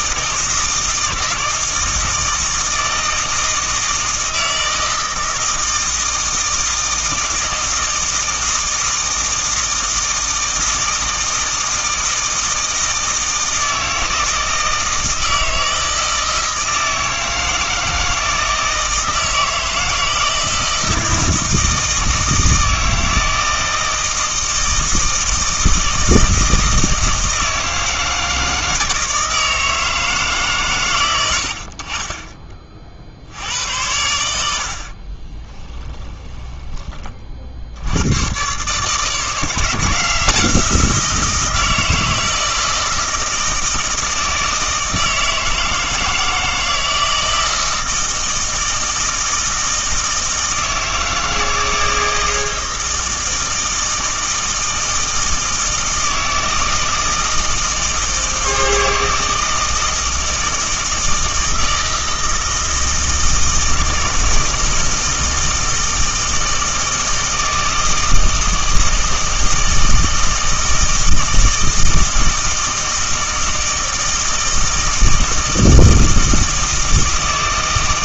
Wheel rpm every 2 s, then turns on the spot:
160, 160, 160, 160, 160, 160, 160, 160, 160, 160, 160, 160, 160, 160, 160, 130, 40, 70, 20, 130, 170, 160, 160, 160, 160, 160, 160, 160, 160, 160, 160, 160, 160, 160, 160, 160, 160, 160, 160.
none